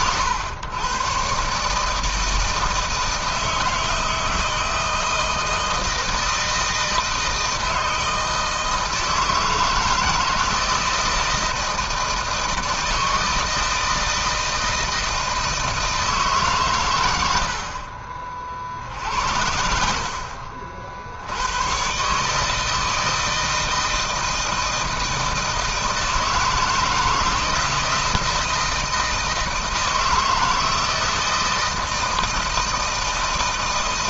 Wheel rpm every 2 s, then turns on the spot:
120, 160, 170, 160, 160, 160, 160, 160, 110, 60, 80, 160, 160, 160, 160, 160, 160.
16-18